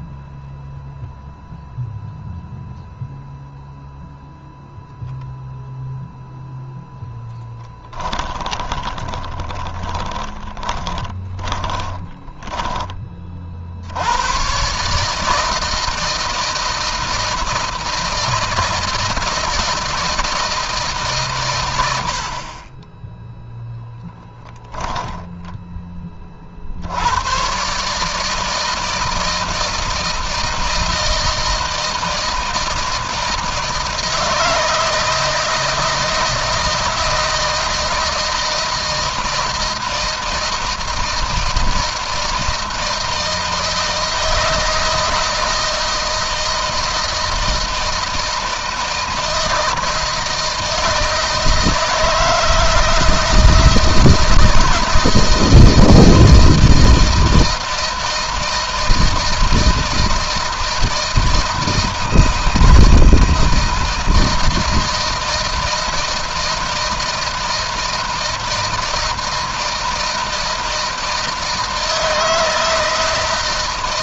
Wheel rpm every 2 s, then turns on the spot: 0, 0, 0, 0, 20, 20, 20, 130, 160, 160, 150, 20, 10, 60, 160, 160, 160, 160, 160, 160, 160, 160, 170, 160, 160, 160, 160, 160, 160, 160, 160, 160, 160, 160, 160, 160, 160.
8-12 24-26